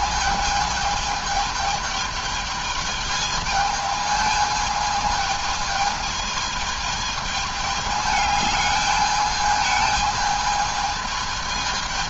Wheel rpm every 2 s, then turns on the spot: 220, 220, 210, 210, 210, 220.
none